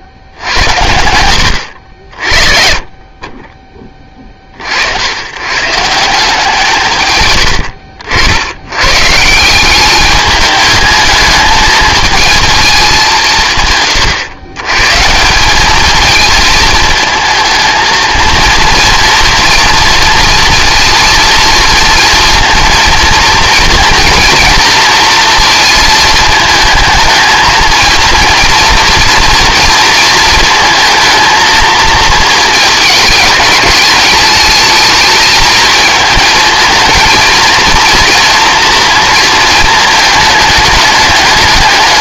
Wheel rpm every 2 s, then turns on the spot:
80, 40, 70, 140, 130, 210, 200, 140, 220, 230, 230, 230, 230, 220, 240, 230, 220, 220, 220, 230, 210.
none